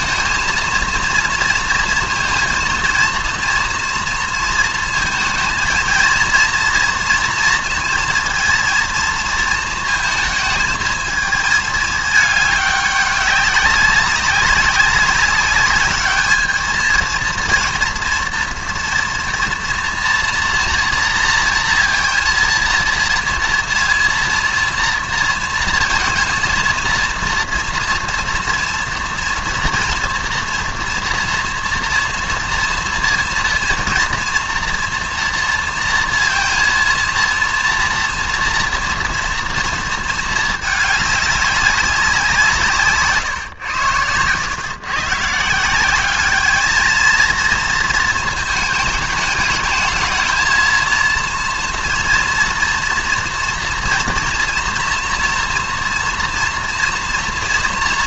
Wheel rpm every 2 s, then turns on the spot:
230, 230, 230, 230, 230, 220, 200, 200, 220, 230, 240, 230, 230, 230, 230, 240, 230, 230, 230, 230, 220, 170, 120, 220, 220, 220, 230, 230, 230.
none